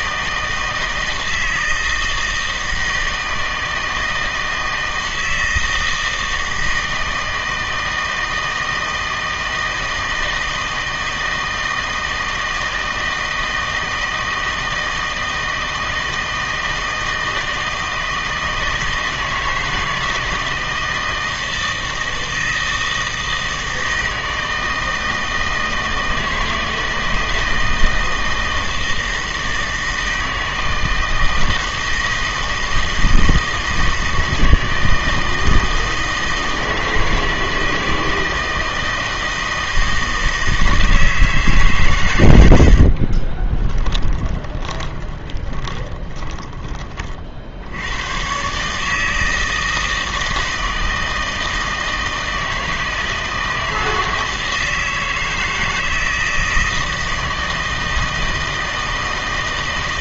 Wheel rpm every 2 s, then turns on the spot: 160, 160, 160, 160, 160, 160, 160, 160, 160, 170, 160, 160, 160, 160, 160, 160, 160, 160, 160, 160, 160, 60, 10, 20, 140, 160, 160, 160, 160, 160.
42-46